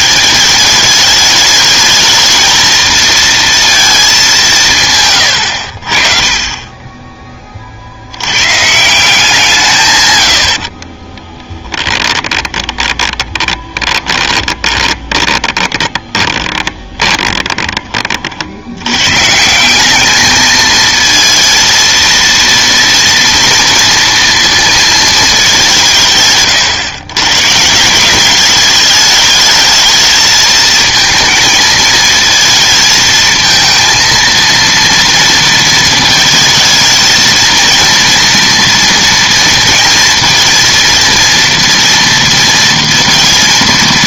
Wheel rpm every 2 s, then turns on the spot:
210, 230, 170, 20, 150, 50, 20, 30, 20, 80, 220, 230, 230, 120, 210, 220, 220, 230, 220, 230, 230, 230.
10-18